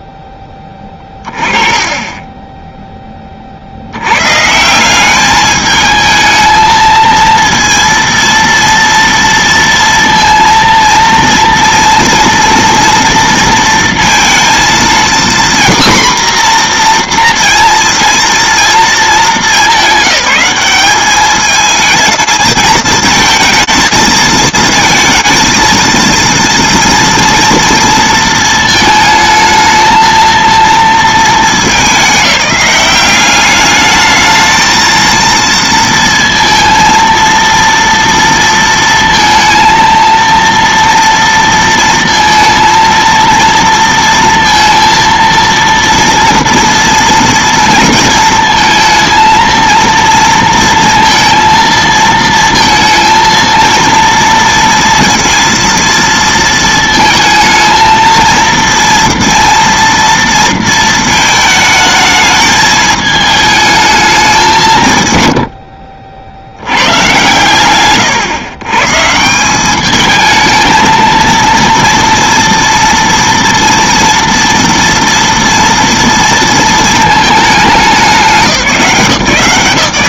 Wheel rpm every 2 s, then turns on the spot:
0, 20, 80, 220, 230, 230, 230, 230, 250, 230, 200, 220, 220, 230, 230, 230, 200, 220, 230, 230, 230, 230, 230, 230, 230, 230, 230, 230, 230, 230, 230, 210, 190, 100, 130, 220, 230, 240, 230, 190.
none